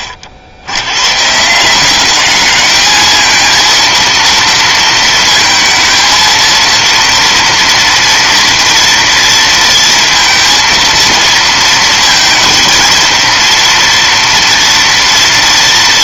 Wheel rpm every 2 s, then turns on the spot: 70, 220, 230, 230, 230, 230, 230, 240.
none